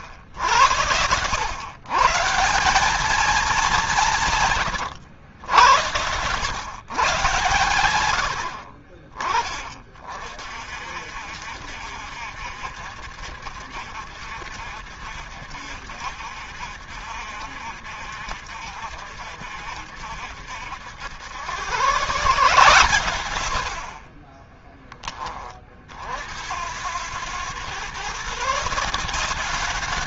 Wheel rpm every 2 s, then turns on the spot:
100, 200, 120, 140, 50, 60, 60, 60, 70, 70, 80, 130, 20, 90, 170.
0-2